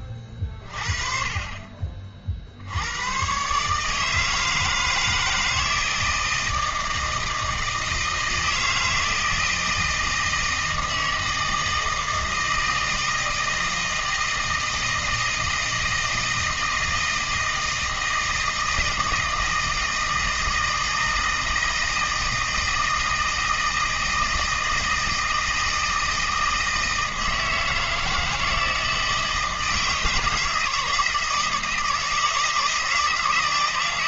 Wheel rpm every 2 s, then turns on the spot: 30, 70, 160, 160, 160, 160, 160, 160, 160, 160, 160, 160, 160, 160, 160, 160, 160.
none